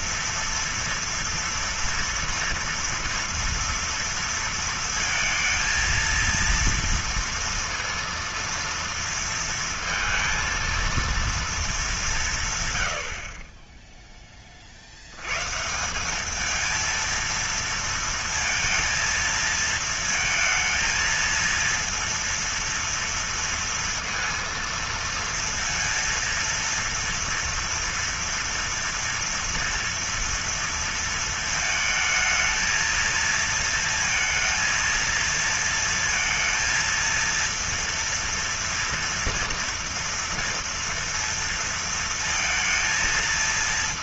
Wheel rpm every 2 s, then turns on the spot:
230, 230, 230, 230, 230, 230, 150, 30, 210, 230, 220, 230, 230, 230, 230, 230, 220, 230, 230, 230, 230, 230.
none